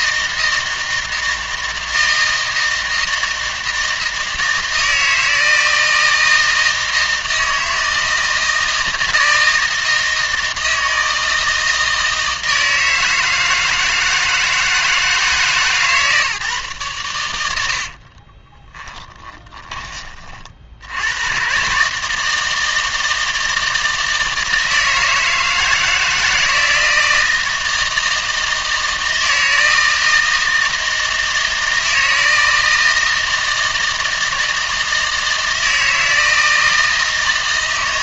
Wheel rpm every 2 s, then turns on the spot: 160, 160, 160, 160, 160, 160, 160, 160, 130, 20, 60, 160, 160, 160, 160, 160, 160, 160, 160.
18-20